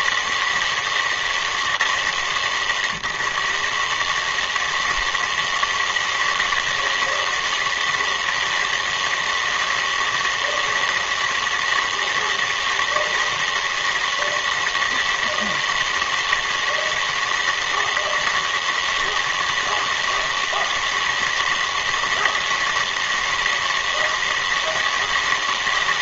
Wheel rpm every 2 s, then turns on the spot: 150, 130, 160, 160, 160, 160, 160, 160, 160, 160, 160, 160, 160.
none